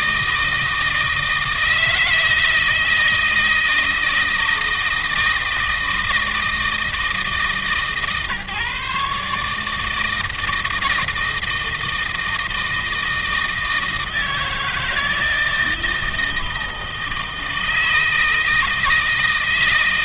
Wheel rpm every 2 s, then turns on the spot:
160, 160, 160, 160, 140, 160, 160, 160, 160, 160.
none